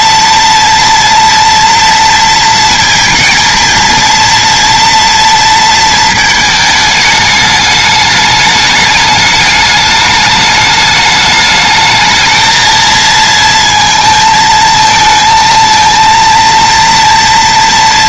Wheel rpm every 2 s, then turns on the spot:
240, 230, 240, 220, 210, 210, 220, 220, 230.
none